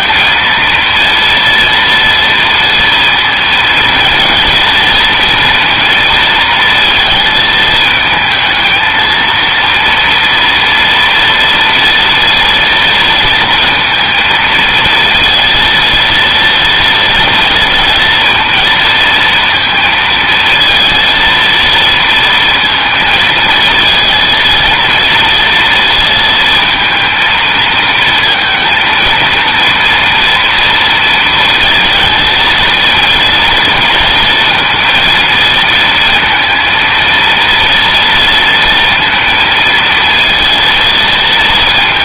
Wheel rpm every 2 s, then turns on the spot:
230, 230, 230, 220, 220, 230, 230, 230, 230, 230, 230, 230, 230, 230, 230, 230, 220, 230, 230, 230, 230.
none